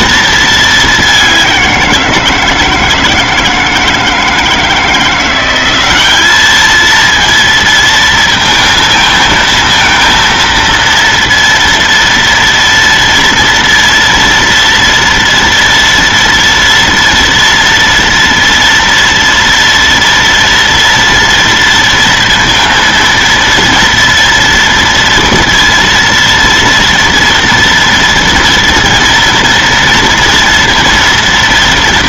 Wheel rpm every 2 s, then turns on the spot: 210, 160, 160, 220, 230, 230, 230, 230, 230, 230, 230, 230, 230, 230, 230, 230.
none